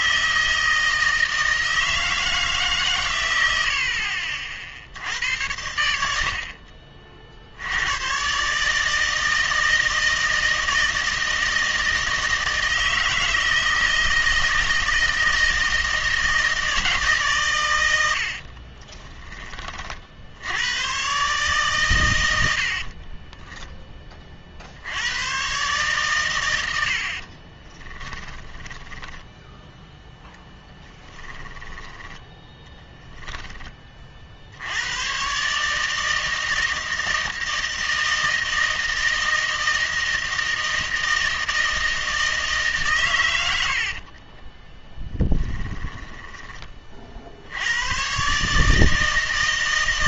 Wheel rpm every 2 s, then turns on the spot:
160, 140, 60, 40, 150, 160, 160, 160, 160, 30, 110, 60, 70, 100, 10, 10, 10, 80, 160, 160, 160, 140, 10, 30, 150.
18-20 22-24 28-32 44-46